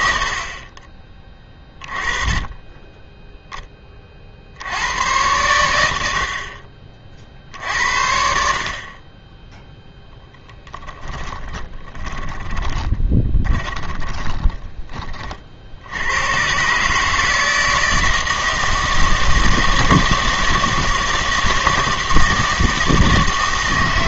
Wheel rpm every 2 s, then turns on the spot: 30, 10, 90, 30, 50, 10, 20, 20, 140, 160, 160, 160.
10-14